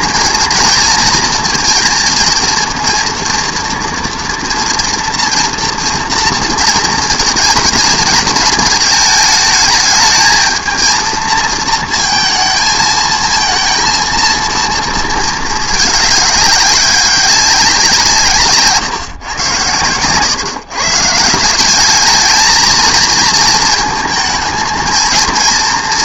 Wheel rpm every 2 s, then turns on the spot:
230, 230, 230, 230, 220, 220, 220, 230, 200, 140, 130, 220, 220.
none